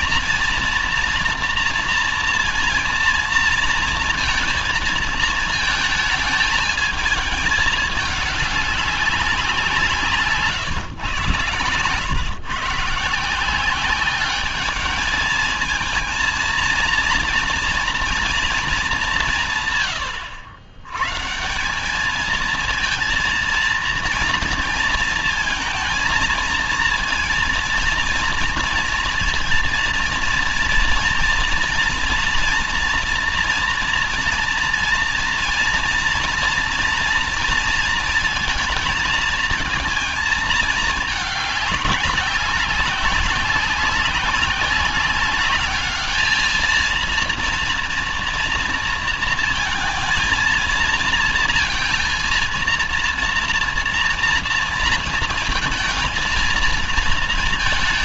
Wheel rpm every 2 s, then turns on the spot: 230, 230, 230, 210, 190, 120, 160, 220, 230, 190, 150, 230, 230, 230, 230, 230, 230, 230, 230, 230, 210, 190, 200, 230, 230, 230, 230, 230, 220.
none